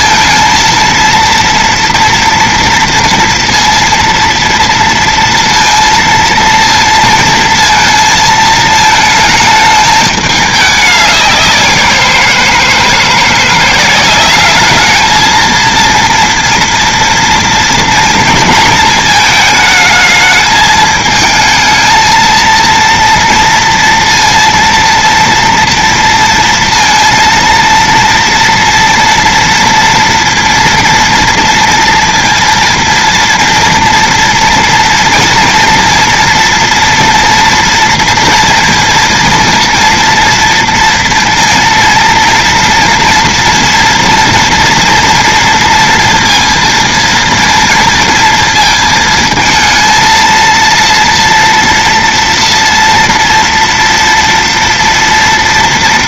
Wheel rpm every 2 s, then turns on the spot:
230, 230, 230, 230, 220, 210, 170, 200, 230, 230, 220, 230, 230, 230, 230, 230, 230, 240, 230, 230, 230, 230, 230, 230, 230, 230, 230, 230.
none